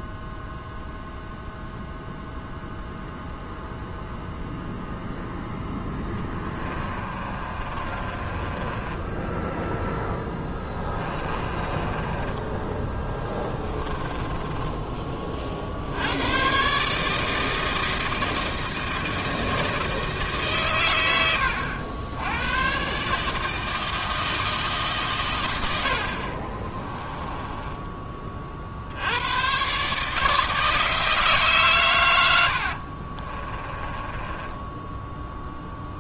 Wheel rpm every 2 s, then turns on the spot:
0, 0, 0, 20, 20, 10, 10, 10, 130, 160, 120, 120, 150, 30, 60, 160, 60, 10.
6-12 14-16 26-28 32-36